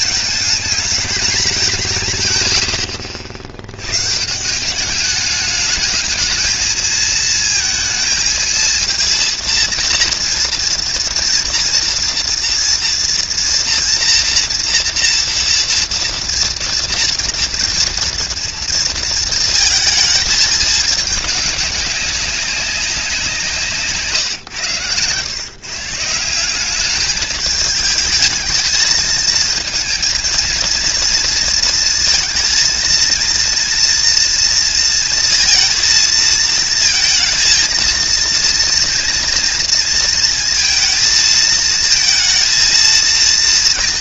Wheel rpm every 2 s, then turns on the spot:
220, 100, 180, 220, 230, 230, 230, 230, 230, 230, 220, 190, 120, 190, 220, 230, 230, 230, 230, 230, 220, 230.
none